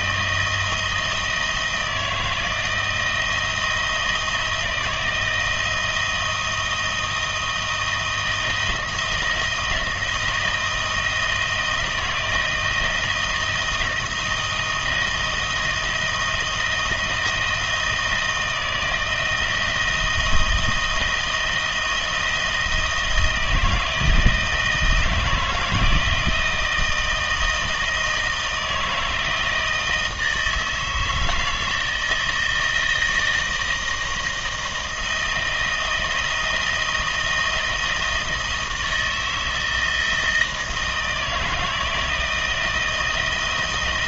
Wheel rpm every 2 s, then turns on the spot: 160, 160, 160, 160, 170, 170, 160, 170, 160, 160, 170, 160, 160, 160, 160, 160, 160, 160, 160, 160, 160, 160.
none